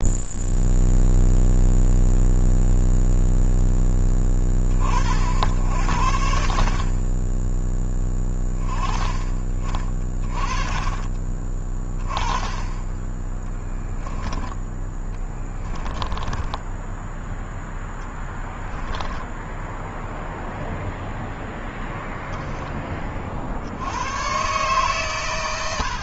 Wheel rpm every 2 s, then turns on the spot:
0, 0, 60, 30, 30, 20, 10, 10, 10, 20, 0, 30, 120.
14-16 18-20